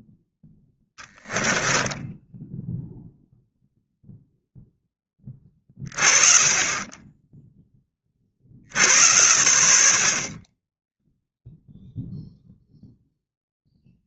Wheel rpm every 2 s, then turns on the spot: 0, 0, 10, 30, 70, 10, 0.
none